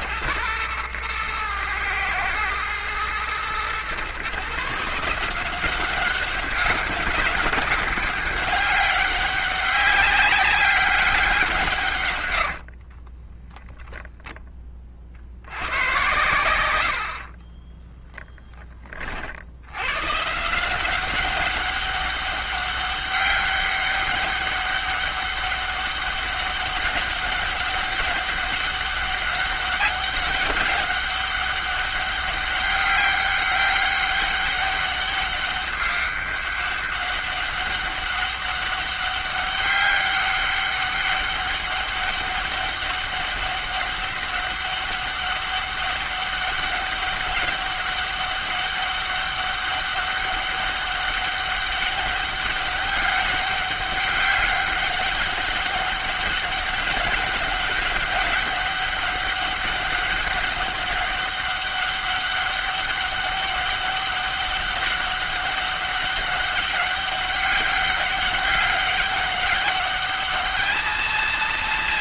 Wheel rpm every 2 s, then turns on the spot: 100, 110, 140, 190, 200, 190, 100, 10, 100, 20, 140, 200, 200, 200, 200, 200, 200, 200, 200, 200, 200, 200, 200, 200, 200, 200, 200, 200, 200, 200, 200, 200, 200, 200, 200, 210.
12-14 18-20